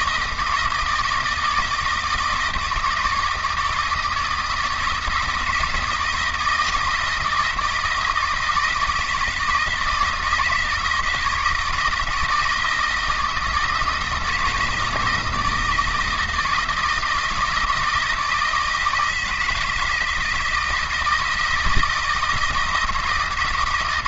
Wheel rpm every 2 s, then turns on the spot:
160, 160, 160, 160, 170, 160, 160, 160, 160, 160, 160, 160.
none